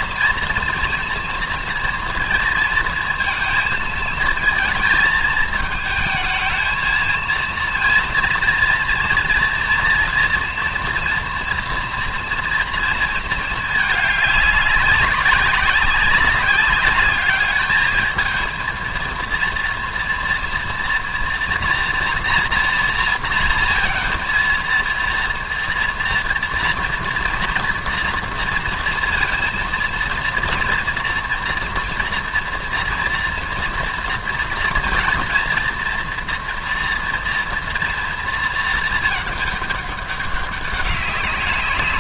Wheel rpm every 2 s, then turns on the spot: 230, 230, 230, 220, 230, 230, 230, 200, 200, 220, 230, 240, 230, 240, 230, 230, 230, 230, 230, 230, 200.
none